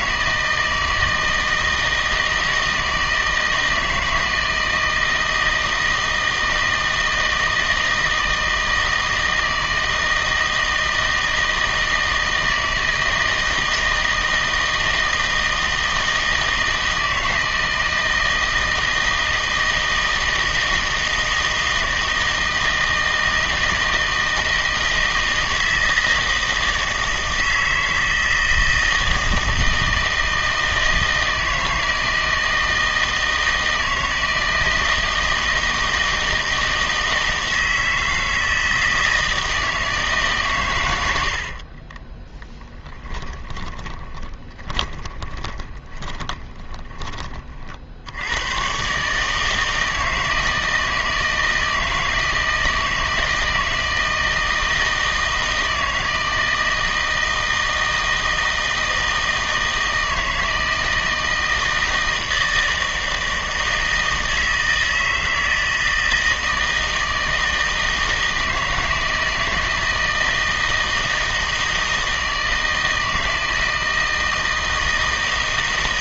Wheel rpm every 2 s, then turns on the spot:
160, 160, 160, 160, 160, 160, 160, 160, 160, 160, 160, 160, 160, 160, 160, 160, 160, 160, 160, 160, 110, 20, 20, 20, 130, 160, 160, 160, 160, 160, 160, 160, 160, 160, 160, 160, 160, 160.
42-48